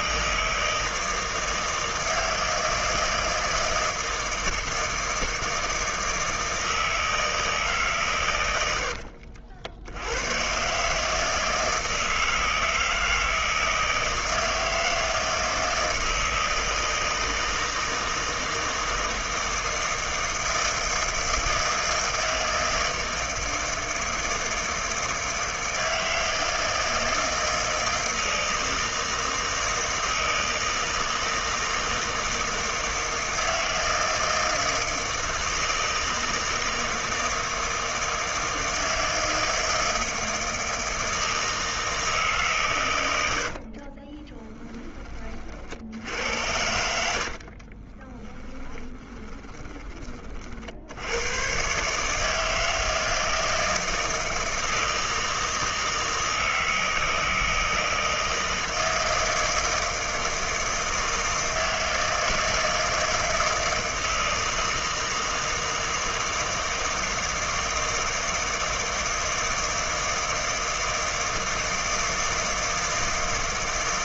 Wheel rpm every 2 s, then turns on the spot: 160, 160, 160, 160, 90, 140, 160, 160, 160, 160, 160, 160, 160, 160, 160, 160, 160, 160, 160, 160, 160, 130, 20, 90, 20, 60, 160, 160, 160, 160, 160, 160, 160, 160, 160, 160, 160.
46-50